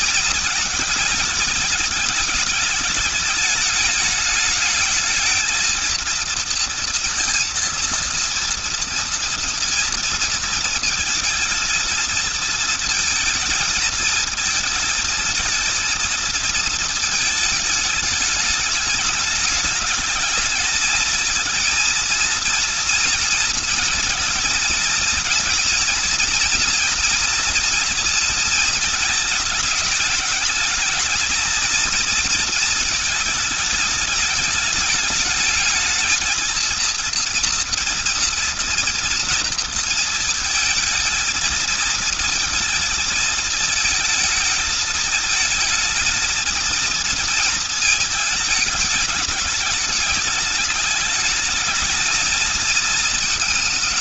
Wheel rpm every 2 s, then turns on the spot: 220, 210, 210, 230, 230, 230, 230, 220, 220, 210, 210, 230, 230, 230, 230, 220, 230, 210, 220, 230, 230, 220, 220, 230, 210, 210, 230.
none